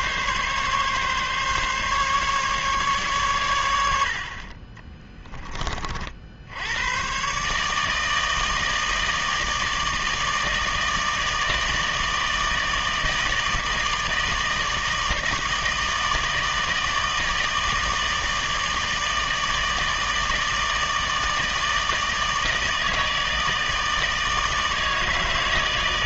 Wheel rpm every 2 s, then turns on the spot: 140, 140, 30, 100, 160, 160, 160, 160, 160, 160, 160, 160, 160.
4-6